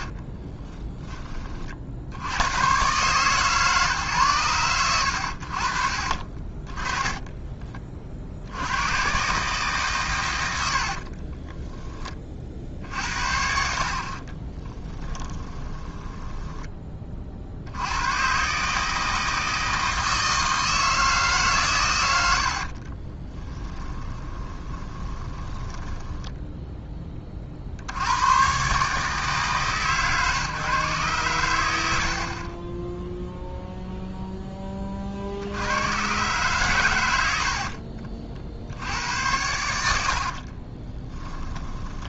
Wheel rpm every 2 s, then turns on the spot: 20, 120, 100, 20, 100, 60, 60, 20, 20, 150, 160, 40, 20, 10, 140, 130, 10, 30, 110, 70, 20.
10-12 14-16 22-26 32-34 40-42